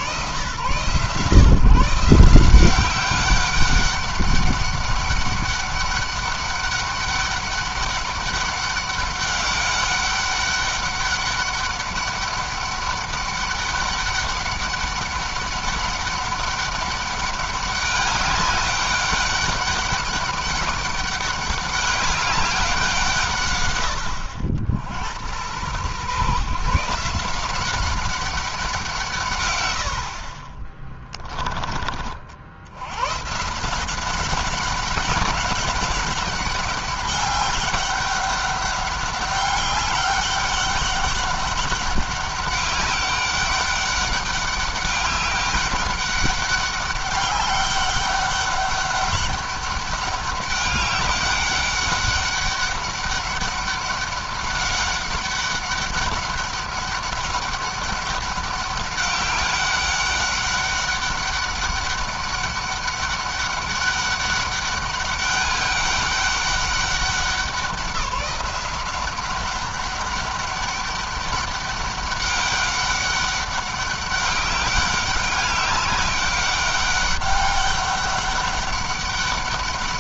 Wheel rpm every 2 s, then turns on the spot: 130, 180, 200, 200, 200, 200, 200, 200, 200, 200, 200, 180, 80, 150, 180, 40, 90, 200, 190, 200, 200, 200, 200, 200, 200, 200, 200, 190, 200, 200, 200, 200, 200, 190, 180, 200, 200, 200, 200, 200.
30-32